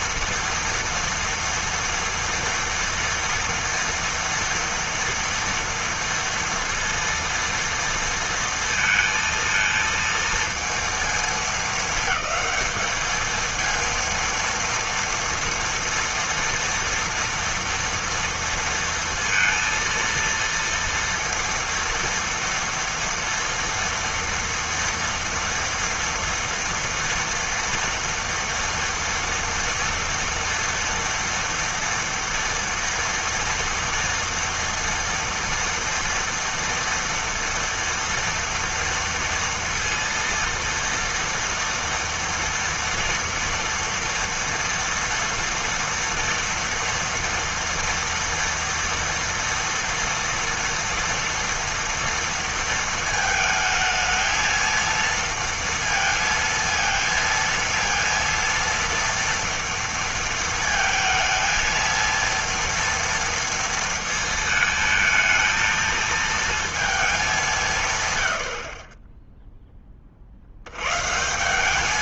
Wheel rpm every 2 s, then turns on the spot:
230, 230, 230, 230, 230, 230, 220, 230, 230, 230, 230, 230, 240, 230, 230, 230, 230, 230, 240, 240, 230, 230, 230, 240, 230, 230, 230, 220, 230, 230, 230, 230, 220, 230, 60, 90.
none